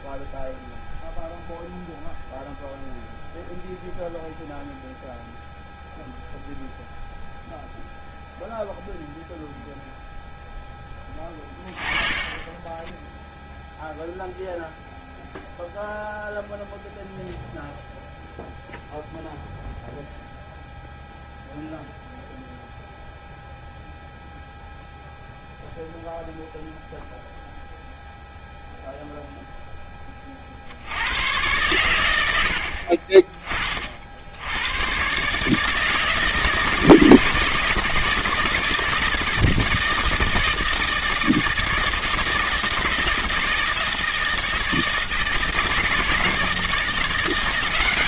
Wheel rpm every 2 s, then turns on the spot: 0, 0, 0, 0, 0, 10, 20, 0, 0, 0, 0, 0, 0, 0, 0, 50, 70, 100, 160, 160, 160, 160, 160, 160.
none